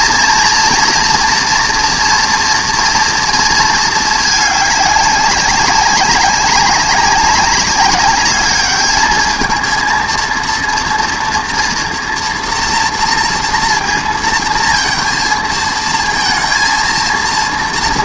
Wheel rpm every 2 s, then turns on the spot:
230, 230, 200, 190, 210, 230, 240, 230, 230.
none